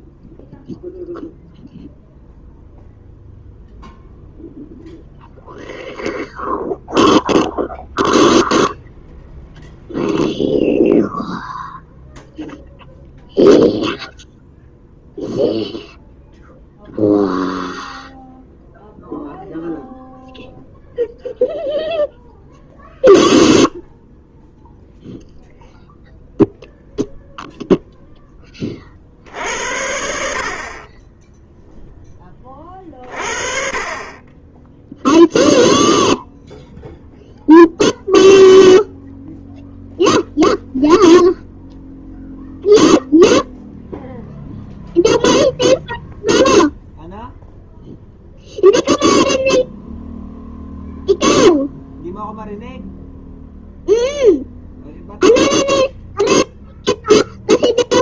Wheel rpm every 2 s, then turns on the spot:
0, 0, 0, 0, 0, 0, 0, 0, 0, 0, 0, 0, 0, 0, 10, 60, 10, 20, 0, 0, 0, 0, 0, 0, 0, 0, 0, 0, 0.
none